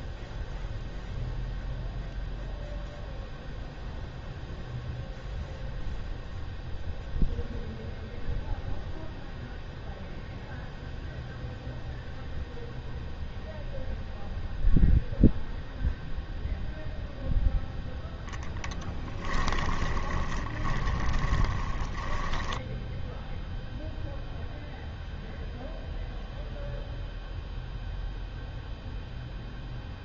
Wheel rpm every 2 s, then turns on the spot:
0, 0, 0, 0, 0, 0, 0, 0, 0, 0, 20, 10, 0, 0, 0.
20-24